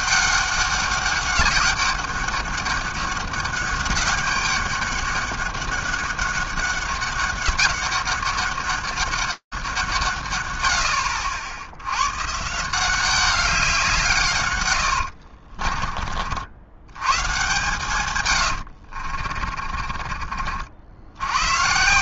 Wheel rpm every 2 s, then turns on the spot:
200, 200, 200, 200, 200, 140, 120, 150, 40, 130, 40.
18-22